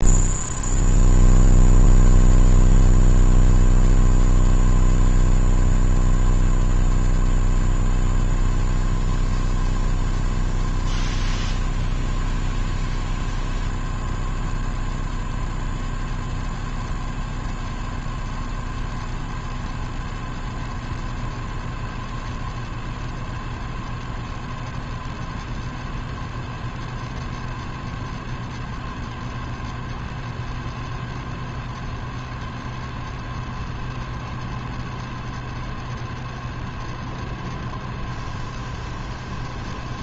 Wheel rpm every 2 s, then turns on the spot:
0, 0, 0, 0, 0, 0, 0, 0, 0, 0, 0, 0, 0, 0, 0, 0, 0, 0, 0, 0.
none